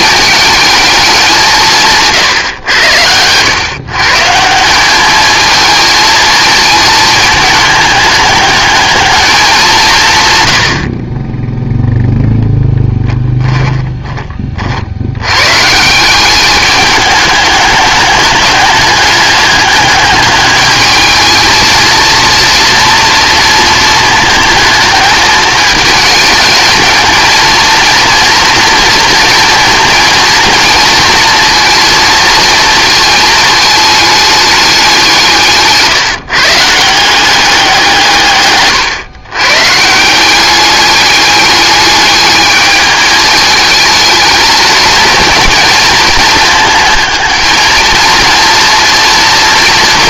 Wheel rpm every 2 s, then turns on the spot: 220, 120, 170, 220, 210, 100, 10, 50, 200, 200, 210, 230, 220, 210, 230, 230, 220, 200, 150, 130, 200, 210, 220, 220, 230.
38-40